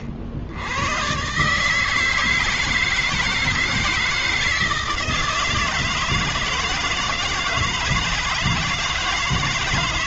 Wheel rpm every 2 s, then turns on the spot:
70, 160, 160, 170, 160.
none